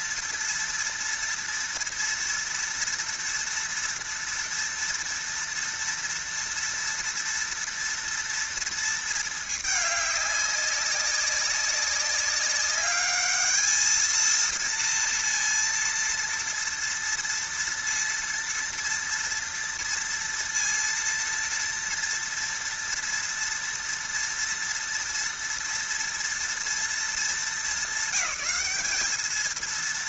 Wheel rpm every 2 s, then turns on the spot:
240, 230, 230, 230, 230, 200, 200, 230, 230, 230, 230, 230, 230, 230, 210.
none